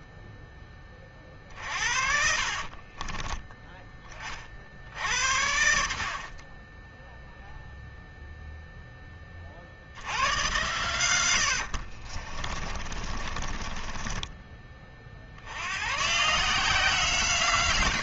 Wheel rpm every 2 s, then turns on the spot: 10, 50, 40, 40, 0, 100, 40, 30, 150.
2-4 10-14